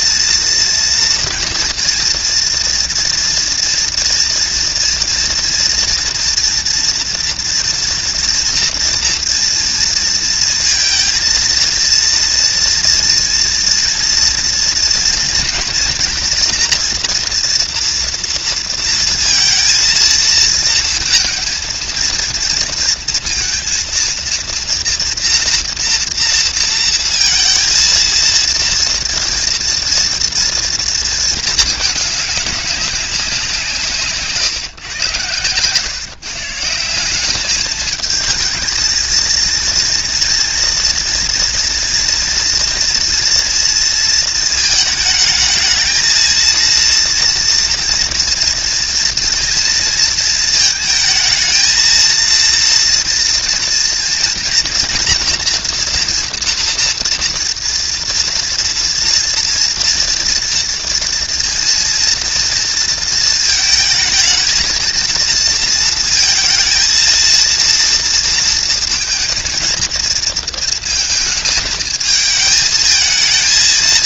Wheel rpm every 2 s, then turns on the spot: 230, 230, 230, 230, 230, 230, 230, 230, 240, 230, 220, 230, 230, 230, 230, 230, 200, 140, 170, 230, 230, 230, 220, 230, 230, 220, 230, 240, 230, 230, 230, 230, 230, 230, 230, 230, 220.
none